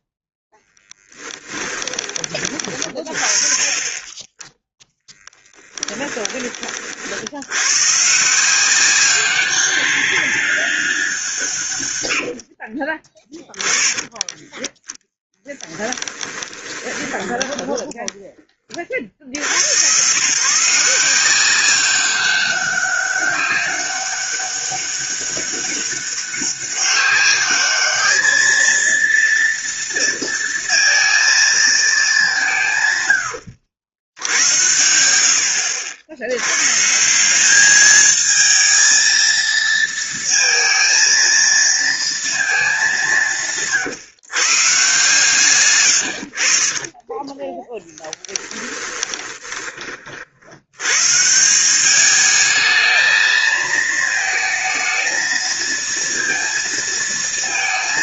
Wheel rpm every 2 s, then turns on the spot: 10, 30, 10, 50, 180, 190, 50, 10, 20, 30, 160, 200, 200, 200, 230, 230, 160, 90, 130, 220, 230, 200, 140, 40, 20, 100, 220, 220, 230.
0-2 16-18 46-50